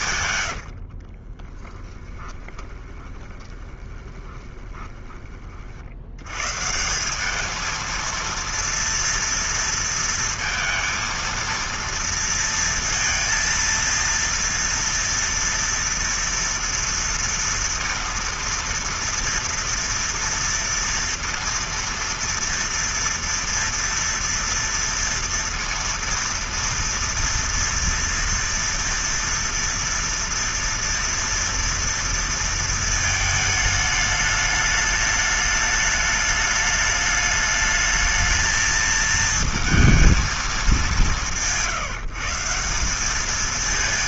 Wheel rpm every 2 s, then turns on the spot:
80, 20, 20, 140, 230, 230, 230, 230, 230, 230, 230, 230, 230, 230, 230, 230, 230, 210, 210, 220, 180, 170.
0-6